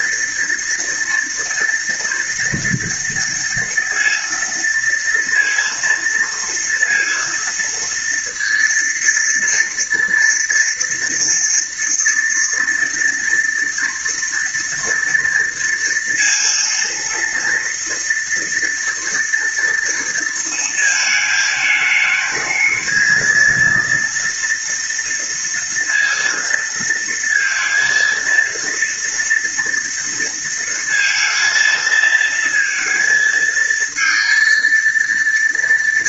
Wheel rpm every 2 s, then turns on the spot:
230, 230, 230, 230, 230, 230, 240, 230, 230, 230, 230, 220, 230, 230, 230, 230, 230, 230.
none